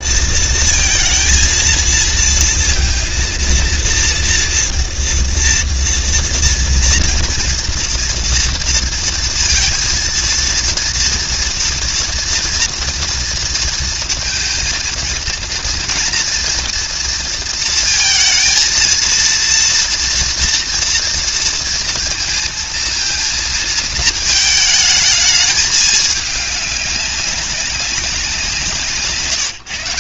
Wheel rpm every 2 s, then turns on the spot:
230, 230, 240, 230, 230, 230, 230, 230, 230, 230, 230, 230, 220, 200, 150.
none